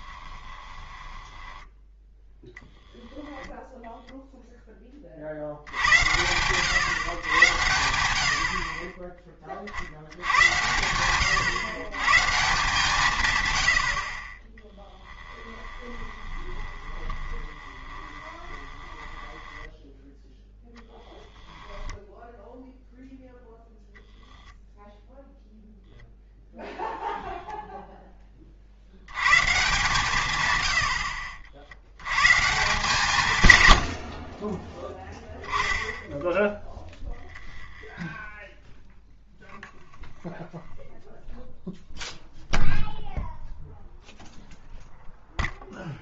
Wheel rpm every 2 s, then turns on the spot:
20, 10, 20, 110, 40, 100, 160, 10, 20, 10, 0, 0, 0, 0, 80, 90, 150, 0, 0, 0, 0, 0, 0.
0-2 14-20